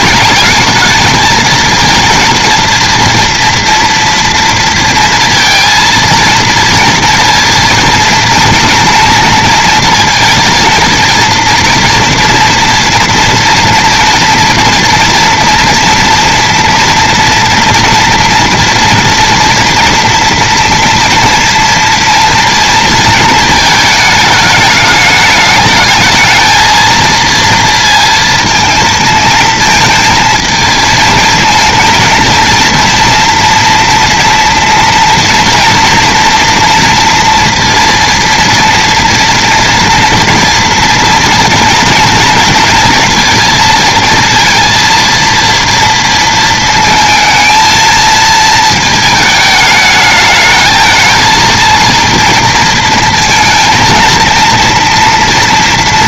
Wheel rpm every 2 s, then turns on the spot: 220, 230, 230, 230, 230, 230, 230, 230, 230, 230, 230, 230, 210, 230, 220, 220, 230, 230, 230, 230, 240, 230, 230, 230, 220, 220, 230, 230.
none